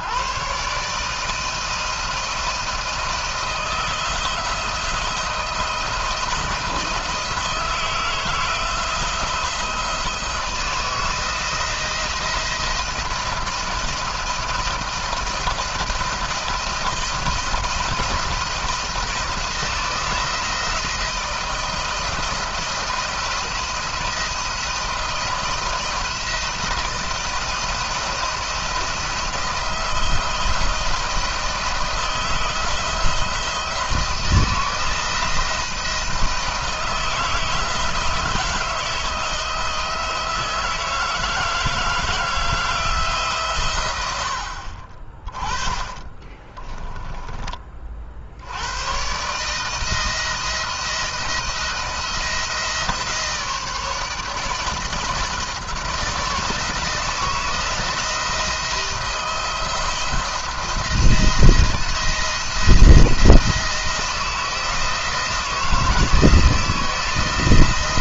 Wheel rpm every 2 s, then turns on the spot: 140, 170, 170, 170, 170, 160, 170, 160, 170, 170, 170, 170, 160, 170, 170, 170, 170, 170, 170, 160, 160, 160, 50, 30, 110, 170, 160, 160, 170, 170, 170, 170, 170, 160.
46-48